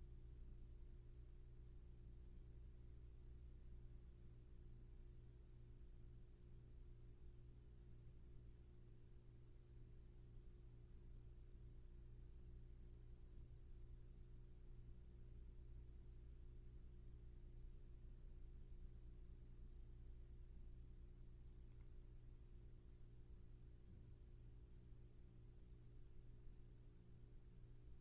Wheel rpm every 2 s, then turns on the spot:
0, 0, 0, 0, 0, 0, 0, 0, 0, 0, 0, 0, 0, 0.
none